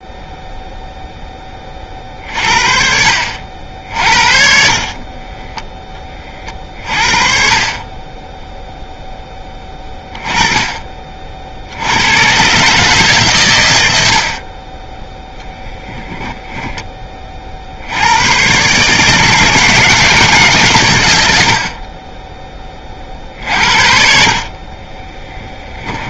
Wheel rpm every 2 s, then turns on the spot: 0, 50, 50, 40, 0, 20, 140, 30, 10, 130, 140, 20, 40.
2-4